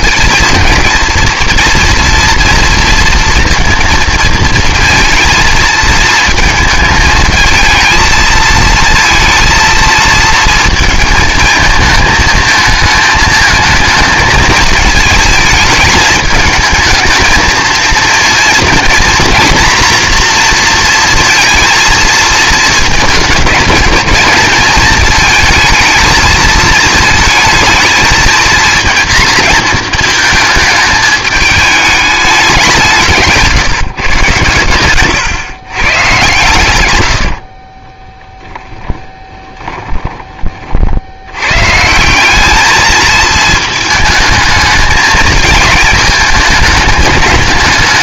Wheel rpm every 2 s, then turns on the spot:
230, 230, 230, 220, 220, 220, 220, 220, 220, 240, 240, 230, 220, 220, 230, 220, 190, 120, 110, 20, 50, 210, 220, 220.
38-40